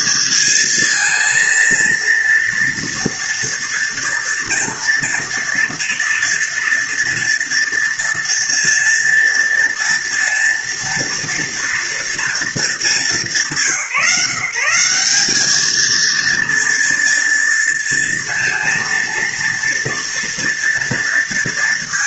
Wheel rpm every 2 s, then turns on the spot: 220, 230, 230, 230, 230, 230, 230, 170, 230, 230, 240.
none